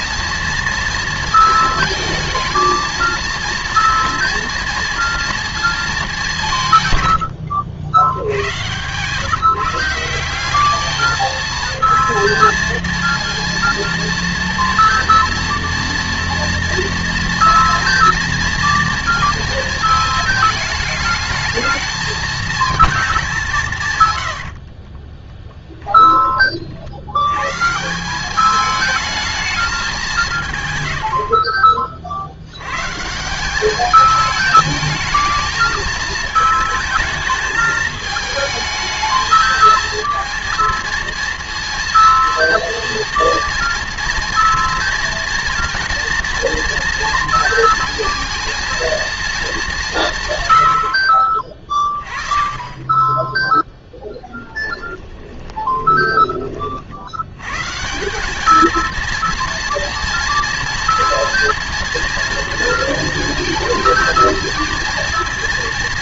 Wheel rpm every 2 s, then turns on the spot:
230, 220, 230, 150, 100, 200, 230, 230, 230, 230, 220, 230, 70, 40, 210, 160, 90, 210, 220, 220, 230, 230, 240, 230, 230, 100, 30, 20, 30, 220, 230, 230, 230.
8-10 24-26 54-56